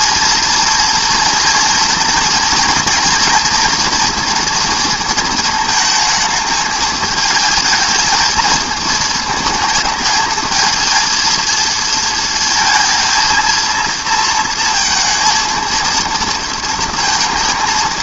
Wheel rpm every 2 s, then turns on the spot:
230, 230, 230, 220, 220, 220, 230, 230, 230.
none